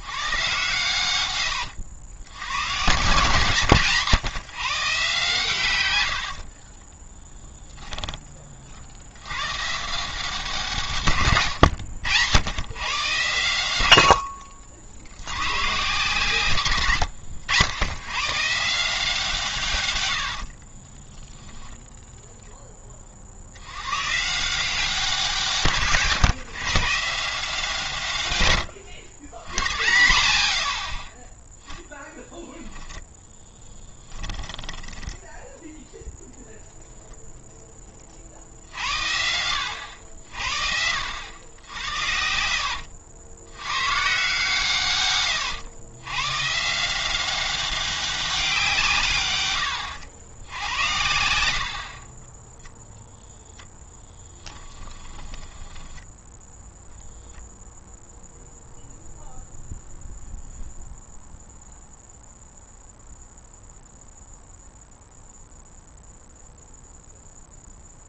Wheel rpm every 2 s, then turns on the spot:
130, 120, 150, 40, 50, 150, 110, 80, 110, 160, 30, 20, 180, 140, 120, 90, 10, 10, 0, 80, 70, 70, 130, 160, 170, 90, 10, 20, 0, 0, 0, 0, 0, 0.
6-8 16-18 20-22 32-36 54-56